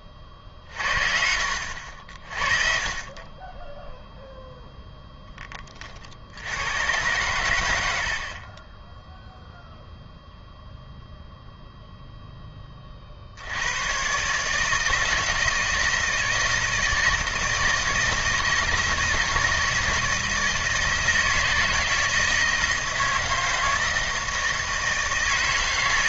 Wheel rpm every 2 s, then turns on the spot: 40, 40, 0, 90, 20, 0, 20, 150, 160, 160, 160, 160, 160.
none